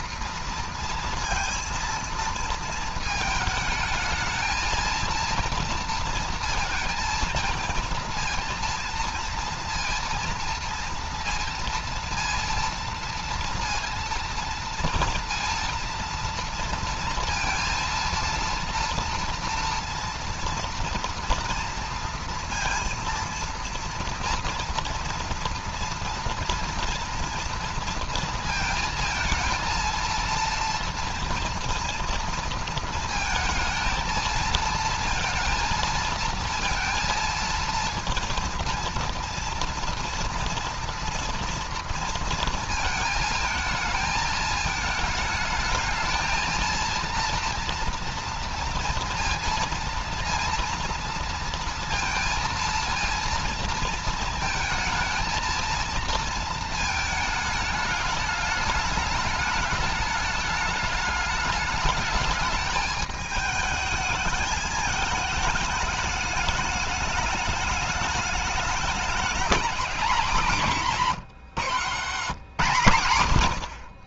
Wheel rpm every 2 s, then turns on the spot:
230, 230, 220, 230, 230, 230, 230, 230, 230, 230, 230, 230, 230, 230, 230, 230, 230, 230, 230, 230, 230, 230, 220, 230, 230, 230, 230, 220, 220, 210, 210, 210, 210, 210, 210, 200, 150.
none